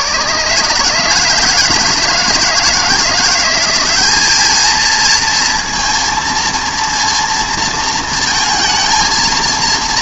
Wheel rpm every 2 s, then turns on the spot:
150, 170, 220, 230, 220.
none